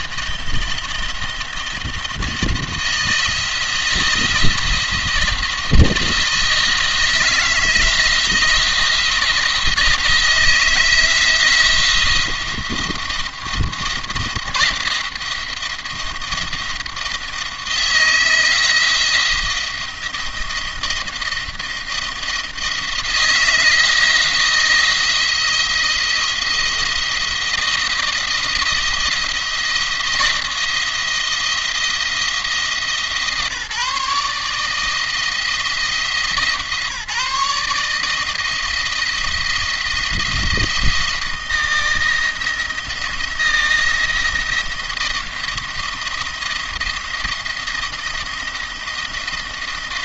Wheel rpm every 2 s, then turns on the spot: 170, 170, 170, 170, 170, 160, 170, 170, 170, 160, 170, 170, 170, 170, 170, 170, 160, 150, 160, 160, 160, 170, 170, 170, 170.
none